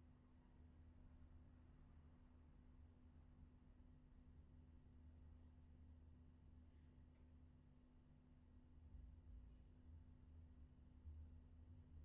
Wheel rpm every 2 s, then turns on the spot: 0, 0, 0, 0, 0, 0.
none